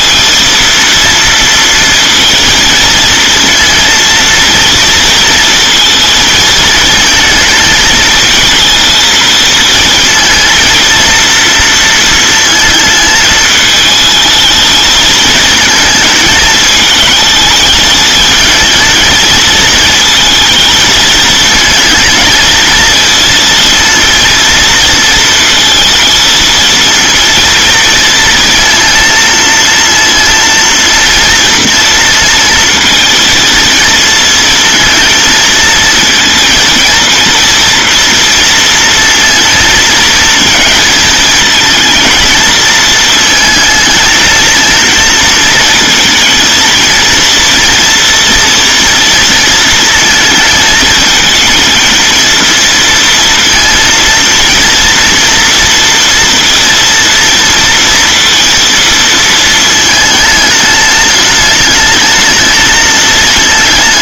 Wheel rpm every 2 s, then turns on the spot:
230, 230, 230, 230, 220, 230, 220, 220, 220, 220, 220, 220, 230, 230, 230, 230, 230, 230, 230, 230, 230, 230, 220, 230, 230, 220, 230, 230, 230, 230, 210, 220.
none